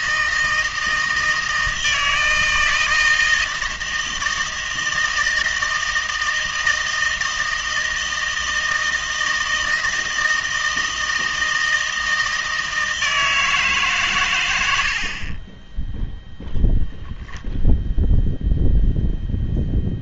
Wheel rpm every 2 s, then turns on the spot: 160, 160, 160, 160, 160, 160, 160, 90, 0, 0.
none